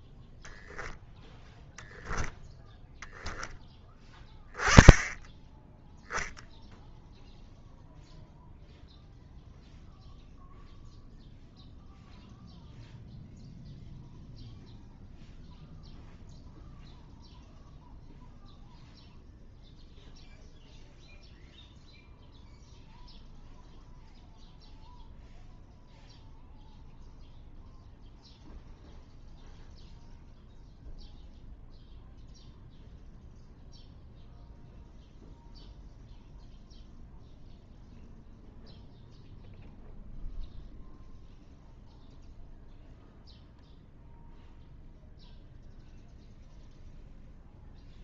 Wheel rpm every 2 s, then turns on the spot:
10, 0, 10, 0, 0, 0, 0, 0, 0, 0, 0, 0, 0, 0, 0, 0, 0, 0, 0, 0, 0, 0, 0, 0.
none